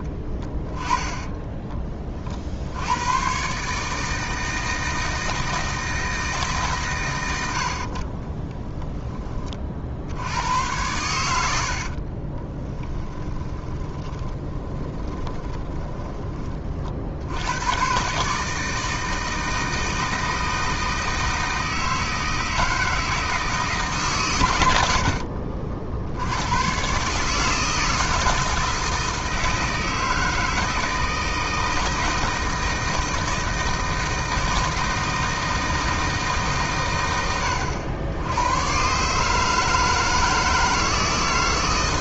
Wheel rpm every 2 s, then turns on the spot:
20, 90, 160, 130, 20, 100, 20, 20, 50, 160, 160, 160, 90, 130, 160, 160, 160, 160, 130, 120, 160.
0-2 12-16